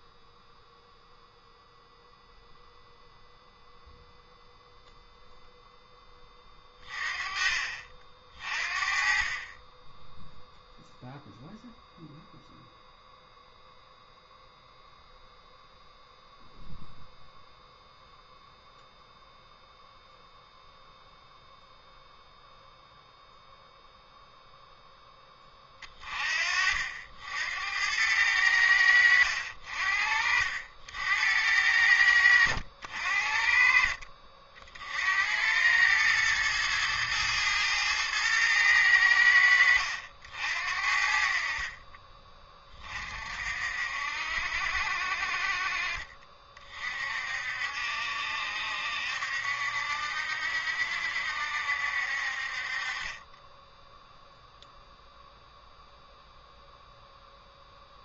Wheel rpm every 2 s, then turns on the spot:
0, 0, 0, 30, 40, 0, 0, 0, 0, 0, 0, 0, 10, 60, 80, 70, 70, 60, 110, 90, 60, 30, 60, 40, 70, 70, 40, 0, 0.
none